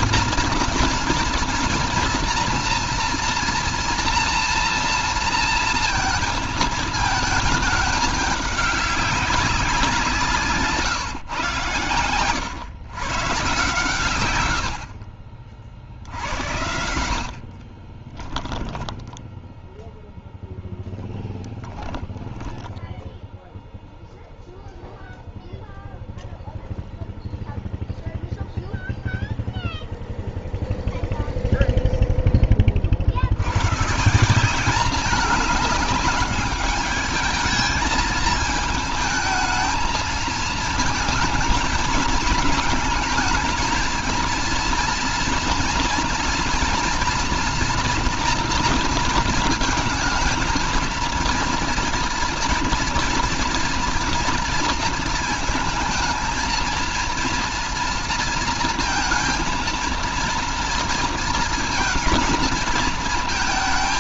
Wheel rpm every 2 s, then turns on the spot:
230, 230, 230, 220, 200, 150, 120, 50, 80, 10, 0, 0, 0, 0, 0, 0, 40, 200, 210, 220, 220, 220, 230, 230, 230, 230, 230, 230, 230, 230, 230, 230.
18-20